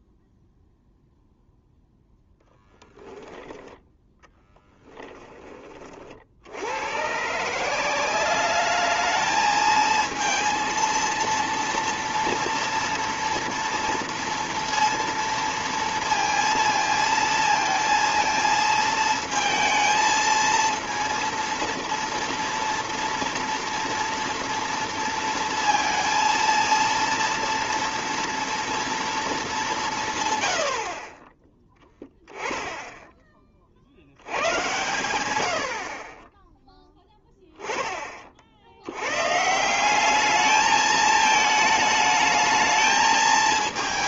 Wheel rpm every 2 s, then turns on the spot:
0, 10, 10, 90, 210, 230, 230, 230, 230, 220, 230, 230, 230, 230, 230, 50, 10, 110, 10, 70, 210, 220.
2-4